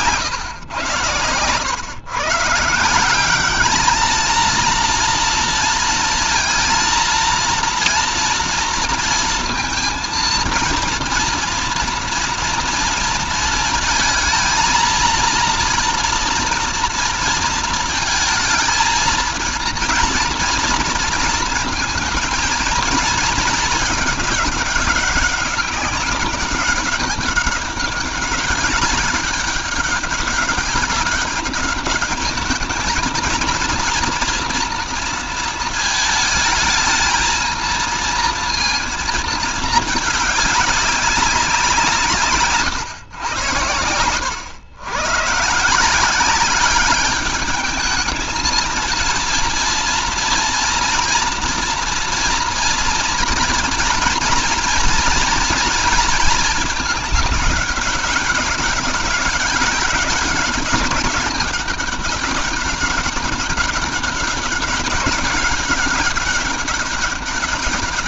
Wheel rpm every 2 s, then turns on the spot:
120, 160, 230, 230, 230, 230, 230, 230, 230, 220, 230, 230, 200, 200, 200, 200, 220, 230, 220, 230, 200, 140, 120, 200, 230, 230, 230, 240, 220, 200, 210, 200, 190, 200.
none